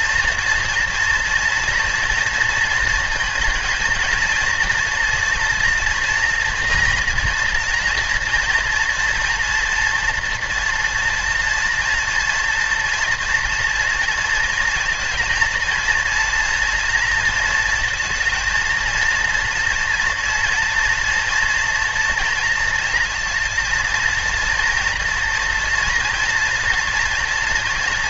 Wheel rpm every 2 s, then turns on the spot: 240, 230, 230, 230, 230, 230, 230, 230, 230, 230, 230, 230, 230, 230.
none